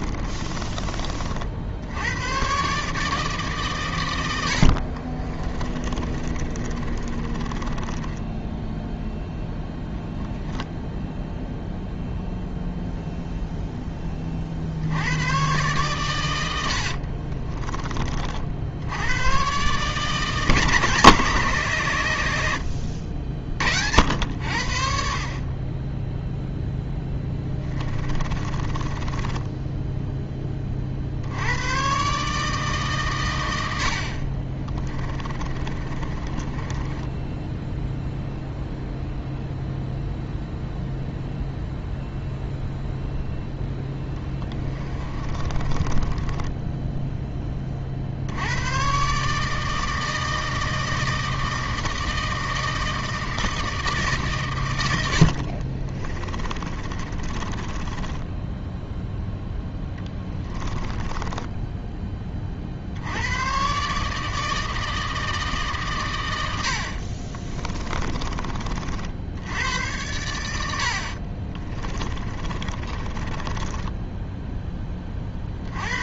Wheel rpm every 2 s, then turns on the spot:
30, 140, 50, 30, 0, 0, 0, 60, 70, 80, 150, 70, 60, 10, 20, 40, 140, 20, 20, 0, 0, 0, 20, 10, 110, 160, 160, 130, 30, 10, 20, 50, 160, 80, 50, 70, 30, 10.
0-2 4-8 16-18 26-30 34-38 44-48 56-58 60-62 66-68 72-74